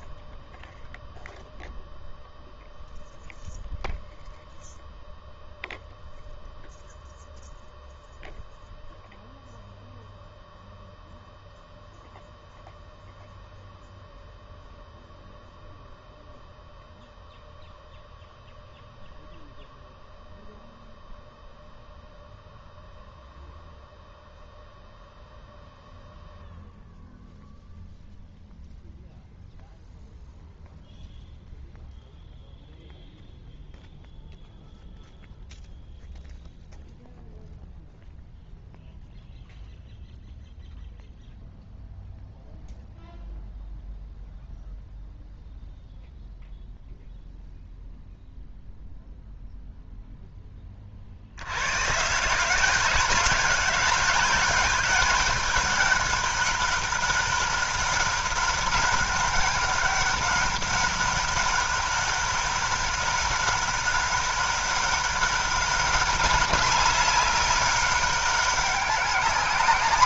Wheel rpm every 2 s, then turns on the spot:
0, 0, 0, 0, 0, 0, 0, 0, 0, 0, 0, 0, 0, 0, 0, 0, 0, 0, 0, 0, 0, 0, 0, 0, 0, 10, 180, 200, 200, 190, 200, 190, 200, 200, 190.
none